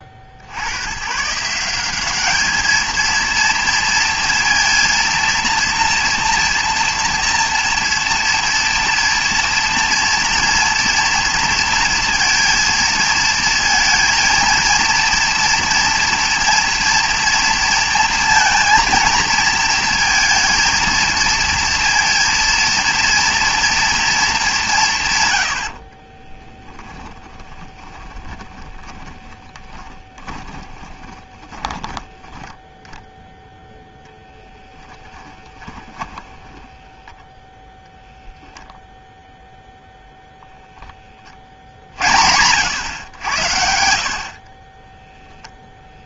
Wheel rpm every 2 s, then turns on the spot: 90, 220, 230, 230, 230, 230, 230, 230, 230, 230, 220, 230, 180, 10, 10, 20, 10, 10, 0, 0, 30, 100, 0.
26-32